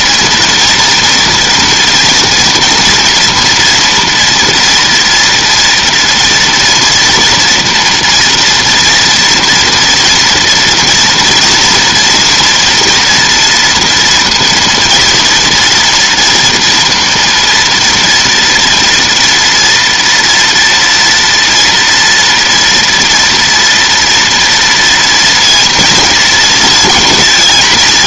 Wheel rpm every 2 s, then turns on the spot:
230, 240, 230, 230, 230, 230, 230, 230, 230, 230, 230, 230, 230, 220.
none